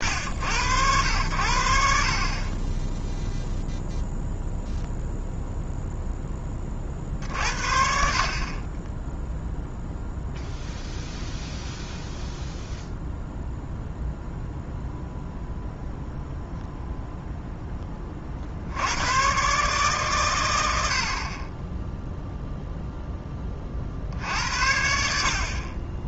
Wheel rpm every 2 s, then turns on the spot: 90, 20, 0, 40, 20, 0, 0, 0, 0, 80, 80, 0, 60.
none